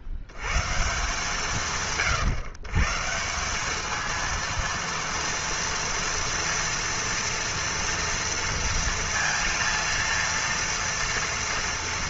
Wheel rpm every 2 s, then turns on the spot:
100, 140, 230, 230, 230, 230.
none